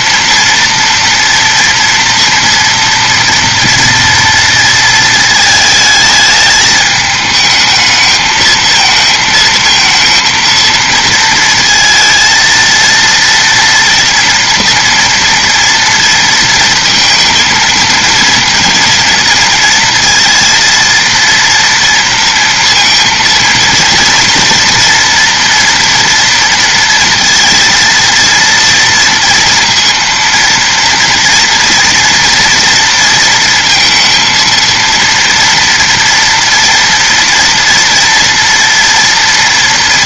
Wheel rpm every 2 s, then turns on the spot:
230, 230, 220, 210, 220, 230, 230, 230, 230, 230, 230, 230, 230, 230, 230, 240, 230, 230, 230, 230.
none